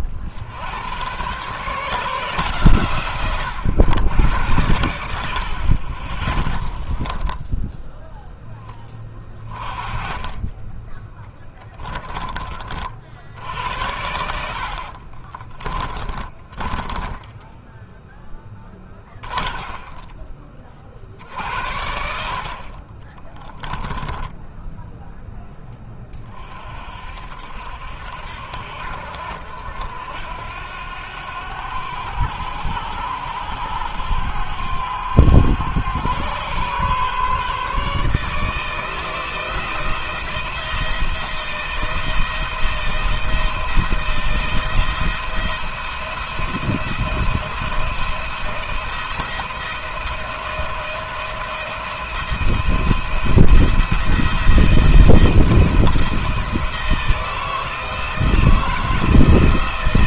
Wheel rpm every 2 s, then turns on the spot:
80, 150, 90, 20, 10, 20, 40, 70, 30, 10, 40, 50, 10, 40, 70, 80, 90, 100, 130, 160, 160, 170, 170, 170, 170, 170, 170, 170, 160, 160.
6-8 16-20 24-26